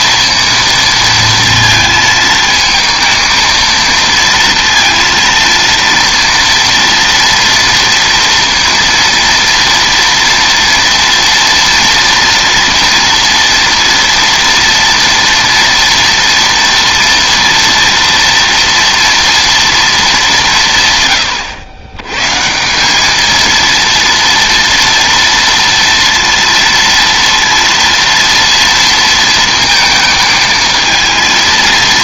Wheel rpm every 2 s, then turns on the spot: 230, 230, 230, 240, 230, 230, 230, 240, 230, 230, 150, 180, 230, 230, 230, 220.
none